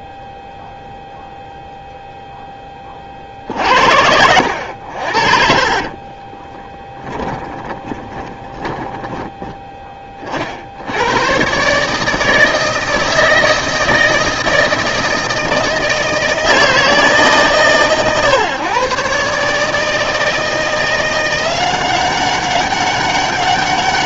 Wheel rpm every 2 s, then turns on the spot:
0, 20, 80, 10, 20, 60, 160, 160, 160, 130, 170, 200.
6-10